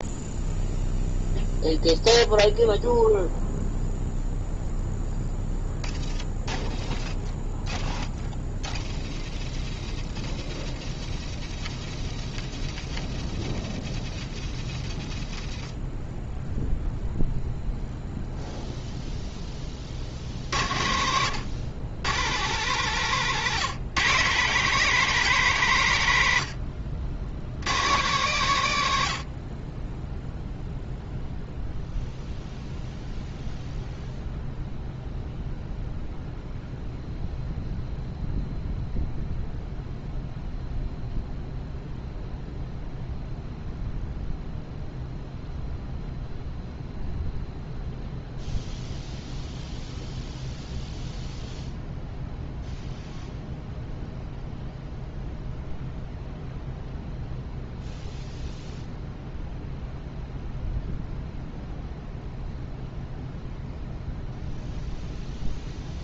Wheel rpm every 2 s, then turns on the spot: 0, 0, 0, 0, 0, 0, 0, 0, 0, 0, 60, 120, 160, 90, 140, 0, 0, 0, 0, 0, 0, 0, 0, 0, 0, 0, 0, 0, 0, 0, 0, 0, 0.
none